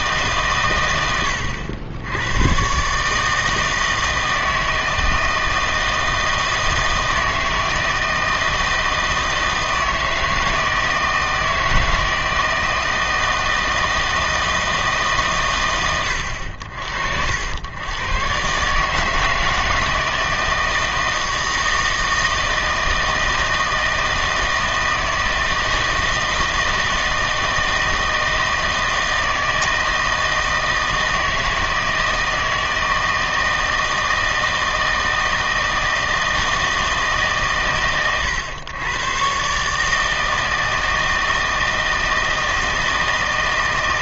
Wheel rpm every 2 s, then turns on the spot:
130, 110, 160, 160, 160, 160, 160, 160, 70, 140, 160, 160, 160, 160, 160, 160, 160, 160, 160, 110, 160, 160.
none